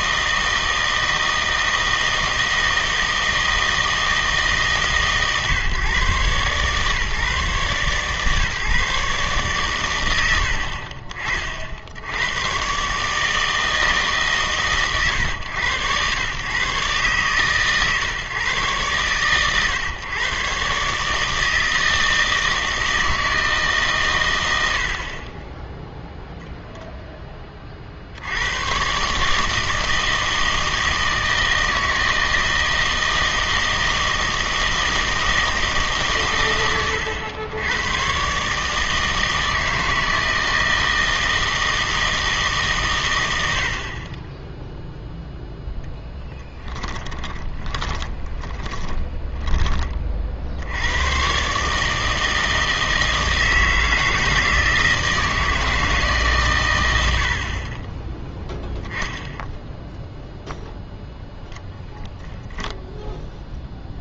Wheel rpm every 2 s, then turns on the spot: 160, 160, 150, 140, 150, 50, 130, 130, 130, 120, 140, 160, 90, 0, 110, 160, 160, 160, 110, 150, 160, 130, 0, 10, 20, 80, 160, 160, 110, 10, 0, 0.
46-50